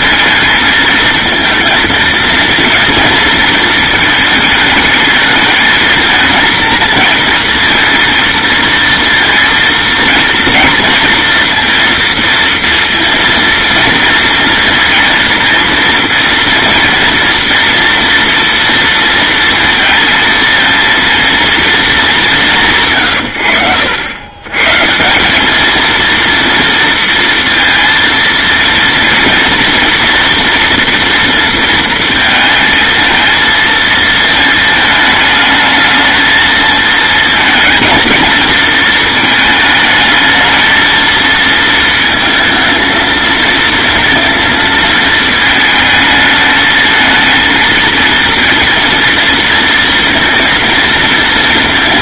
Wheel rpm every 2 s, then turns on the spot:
220, 230, 210, 230, 230, 230, 230, 230, 230, 230, 230, 150, 150, 230, 230, 240, 230, 220, 220, 230, 230, 220, 220, 220, 230, 230.
none